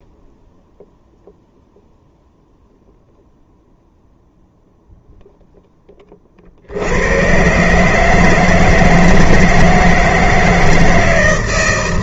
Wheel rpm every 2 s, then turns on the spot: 0, 0, 0, 50, 160, 160.
none